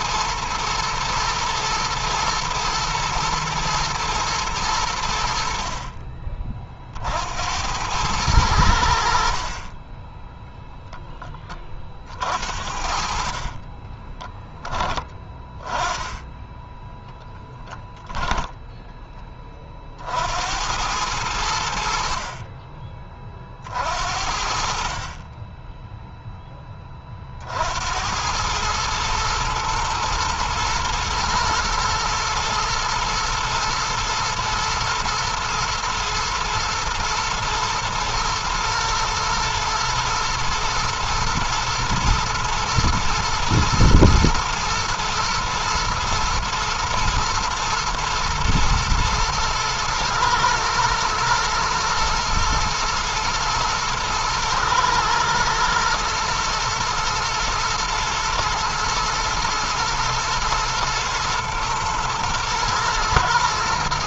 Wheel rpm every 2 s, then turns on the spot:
110, 110, 90, 40, 80, 10, 50, 10, 10, 10, 90, 30, 50, 30, 110, 120, 110, 110, 110, 120, 120, 120, 110, 110, 120, 120, 120, 120, 120, 110, 120, 120.
16-18